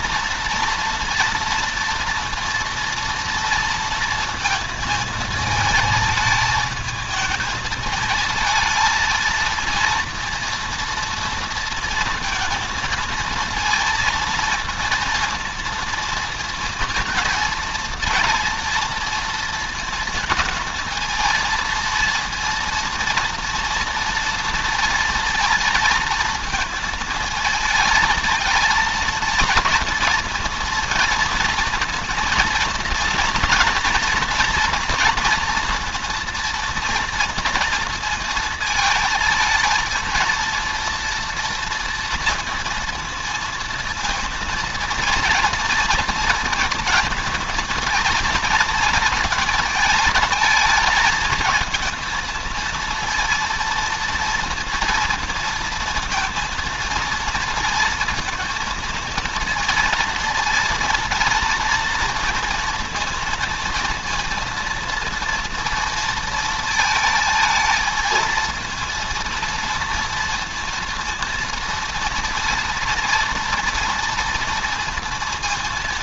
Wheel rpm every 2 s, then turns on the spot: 230, 230, 220, 220, 230, 230, 230, 230, 230, 230, 230, 230, 230, 220, 220, 230, 240, 240, 230, 220, 230, 230, 230, 220, 230, 220, 230, 230, 230, 230, 230, 230, 230, 220, 230, 230, 230, 230.
none